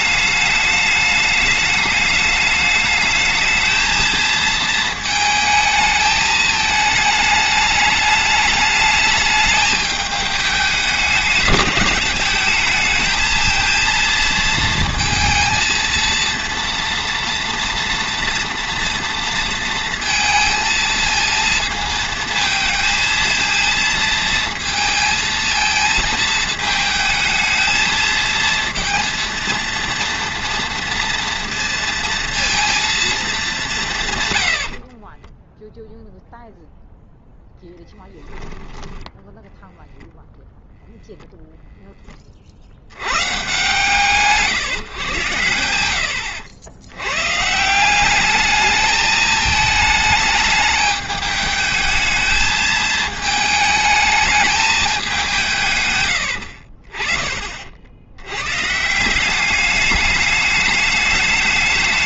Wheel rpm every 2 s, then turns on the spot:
210, 210, 220, 220, 210, 210, 210, 230, 240, 230, 230, 230, 230, 220, 230, 230, 230, 80, 0, 10, 0, 60, 140, 90, 210, 210, 220, 210, 50, 120, 210.
34-36